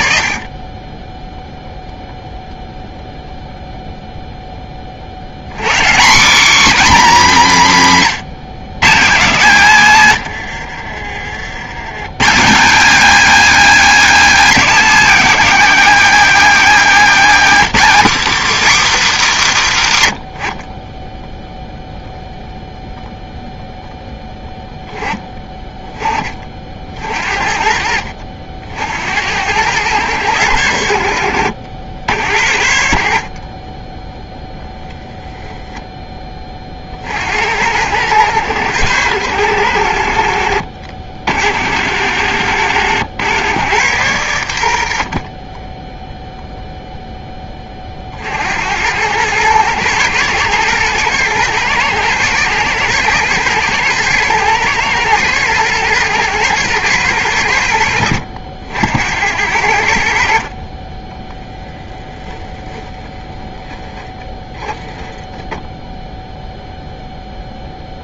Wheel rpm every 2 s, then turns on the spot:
10, 0, 70, 250, 170, 50, 240, 270, 240, 250, 20, 0, 10, 50, 60, 100, 60, 0, 30, 100, 70, 90, 90, 0, 70, 110, 120, 120, 110, 70, 40, 0, 10, 0.
10-12